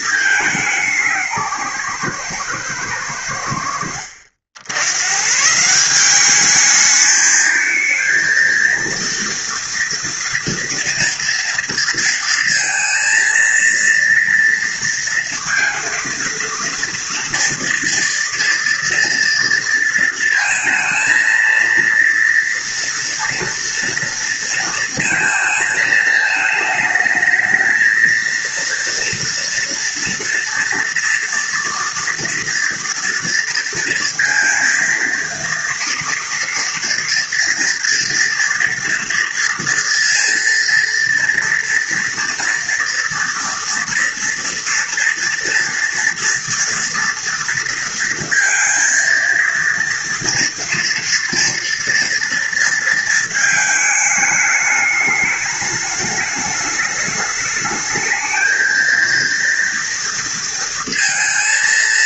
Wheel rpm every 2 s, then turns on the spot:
180, 90, 110, 210, 230, 230, 230, 230, 230, 230, 230, 230, 230, 220, 230, 230, 230, 230, 230, 230, 230, 230, 230, 230, 230, 240, 230, 210, 210, 230, 230.
none